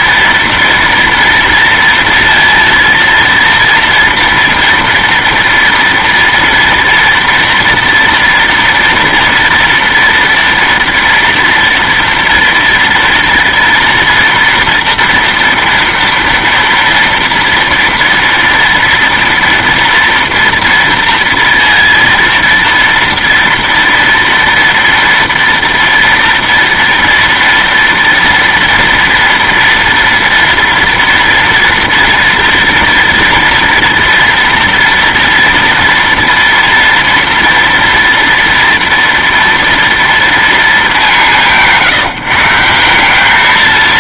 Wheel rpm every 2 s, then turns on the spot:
230, 230, 230, 230, 230, 230, 230, 230, 230, 230, 230, 230, 230, 230, 230, 230, 230, 230, 230, 230, 220, 170.
none